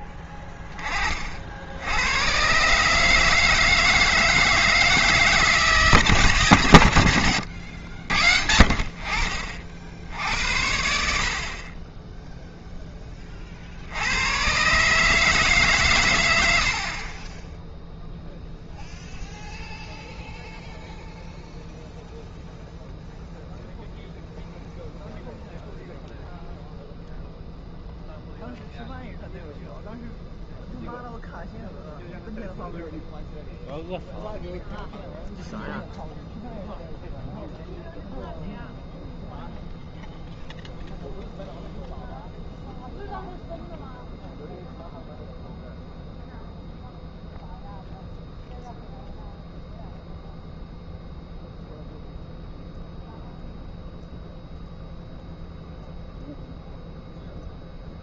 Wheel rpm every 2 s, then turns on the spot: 20, 140, 160, 120, 60, 70, 10, 140, 70, 0, 0, 0, 0, 0, 0, 0, 0, 0, 0, 0, 0, 0, 0, 0, 0, 0, 0, 0, 0.
16-18